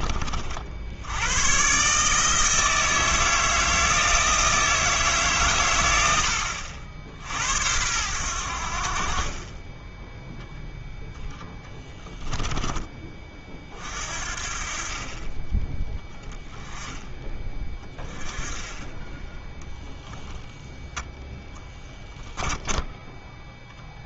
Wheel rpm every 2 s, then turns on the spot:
60, 160, 160, 60, 60, 10, 20, 40, 10, 10, 0, 10.
22-24